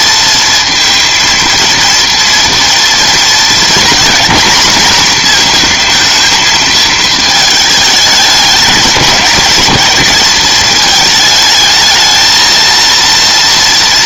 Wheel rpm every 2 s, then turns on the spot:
230, 230, 240, 220, 210, 220, 230.
none